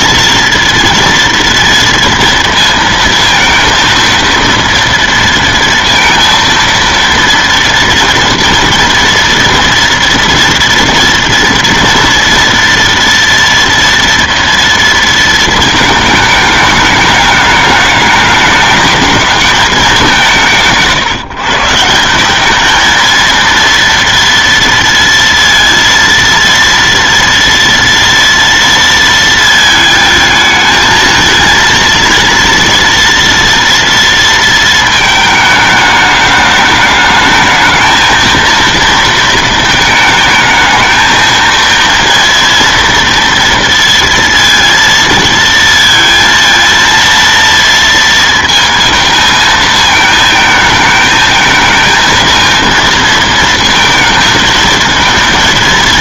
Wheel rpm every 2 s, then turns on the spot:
230, 230, 230, 230, 230, 230, 230, 230, 210, 210, 170, 210, 230, 230, 230, 220, 230, 230, 210, 230, 220, 230, 230, 230, 230, 220, 230, 220.
none